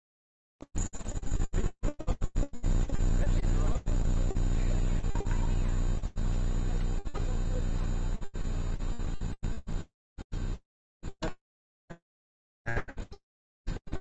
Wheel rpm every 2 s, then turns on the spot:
0, 0, 0, 0, 0, 0, 0.
none